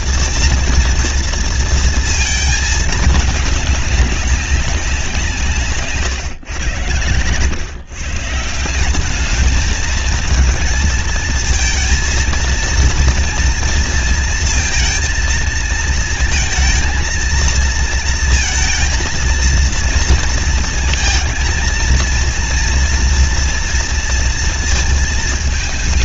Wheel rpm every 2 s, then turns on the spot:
230, 220, 200, 120, 160, 220, 230, 230, 230, 230, 230, 230, 230.
none